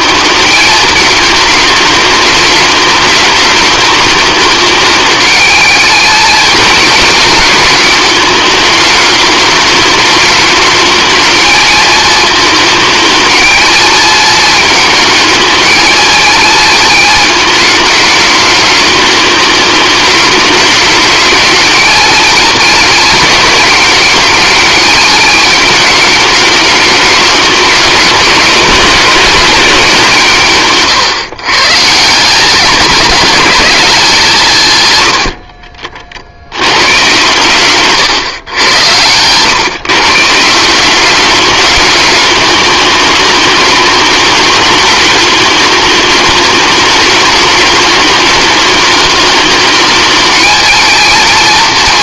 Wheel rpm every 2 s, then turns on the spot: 210, 210, 210, 220, 210, 220, 220, 220, 230, 210, 210, 220, 210, 210, 190, 140, 200, 110, 120, 100, 190, 210, 210, 210, 210, 220.
none